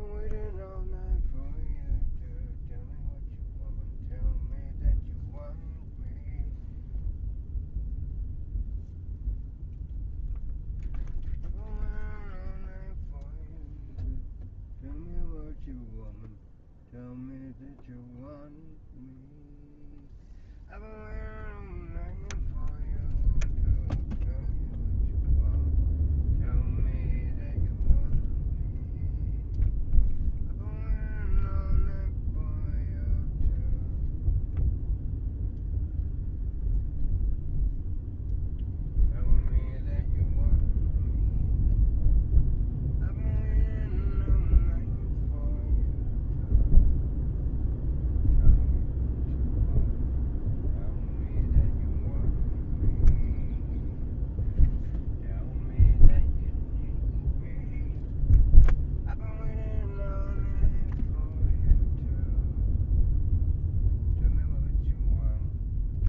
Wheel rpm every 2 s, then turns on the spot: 0, 0, 0, 0, 0, 0, 0, 0, 0, 0, 0, 0, 0, 0, 0, 0, 0, 0, 0, 0, 0, 0, 0, 0, 0, 0, 0, 0, 0, 0, 0, 0, 0.
none